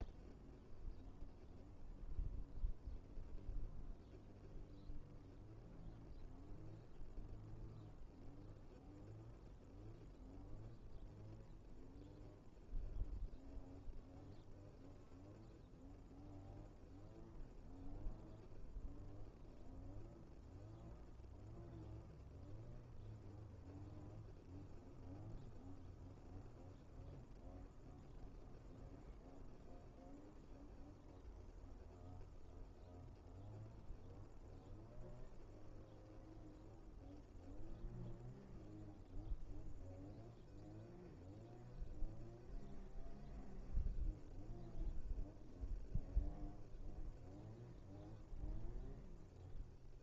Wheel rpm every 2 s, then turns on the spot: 0, 0, 0, 0, 0, 0, 0, 0, 0, 0, 0, 0, 0, 0, 0, 0, 0, 0, 0, 0, 0, 0, 0, 0, 0.
none